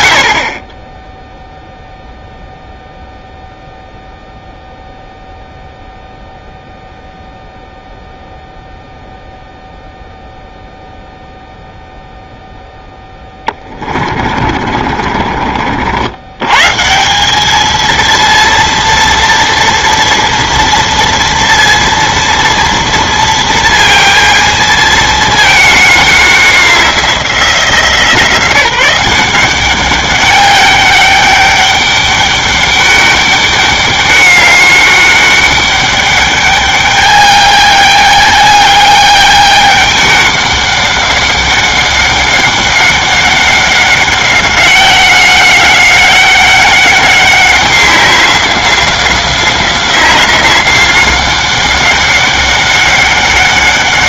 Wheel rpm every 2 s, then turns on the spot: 30, 0, 0, 0, 0, 0, 0, 40, 160, 230, 230, 230, 220, 180, 180, 200, 200, 200, 210, 210, 200, 200, 190, 190, 180, 190, 190.
14-16